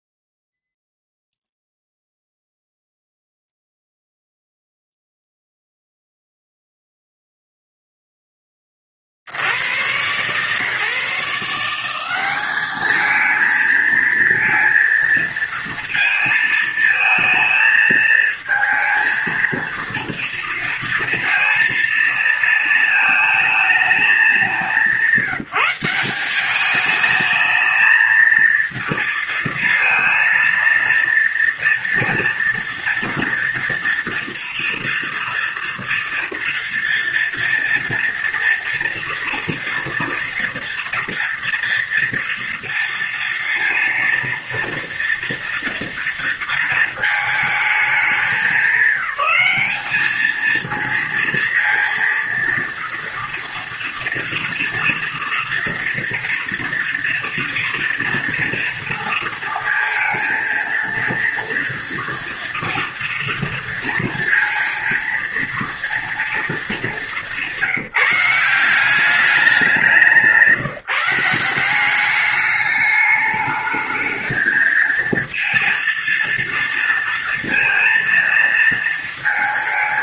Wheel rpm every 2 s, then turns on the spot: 0, 0, 0, 0, 20, 140, 210, 230, 220, 220, 230, 220, 190, 200, 230, 230, 230, 230, 230, 230, 230, 230, 240, 230, 200, 220, 230, 230, 230, 230, 230, 240, 230, 220, 180, 170, 210, 220, 230, 230.
none